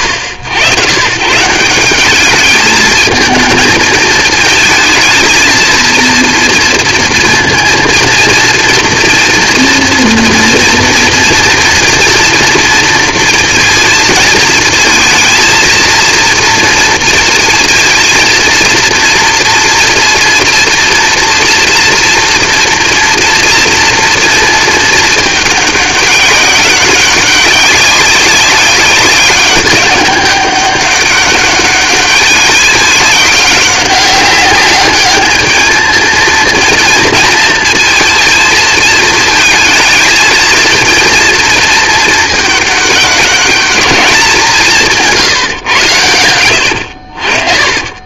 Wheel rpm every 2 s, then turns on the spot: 110, 220, 230, 230, 230, 230, 230, 230, 230, 230, 240, 230, 230, 200, 200, 200, 200, 200, 230, 230, 230, 210, 170, 90.
none